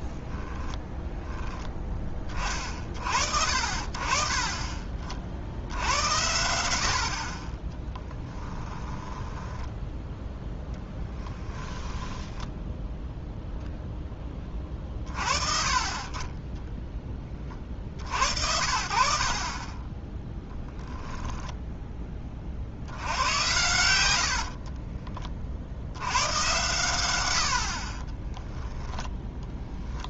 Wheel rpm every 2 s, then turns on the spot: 0, 30, 30, 90, 10, 20, 10, 30, 10, 60, 10, 70, 50, 100, 10.
8-12 24-26 28-30